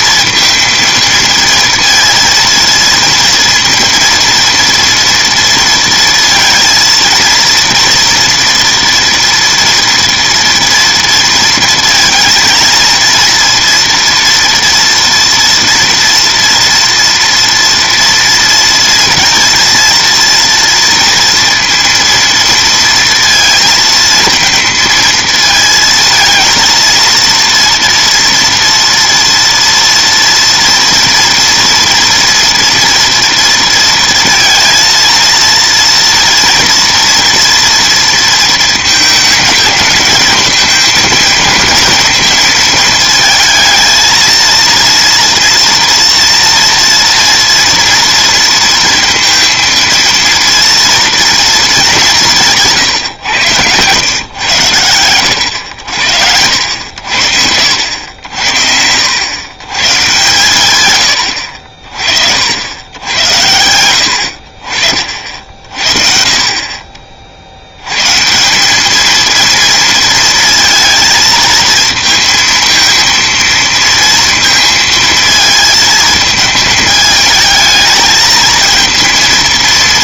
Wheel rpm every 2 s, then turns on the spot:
230, 230, 230, 230, 230, 230, 230, 240, 230, 230, 230, 230, 230, 230, 230, 230, 230, 230, 230, 220, 220, 220, 230, 230, 230, 230, 160, 100, 80, 80, 120, 90, 40, 40, 190, 230, 230, 230, 220, 220.
none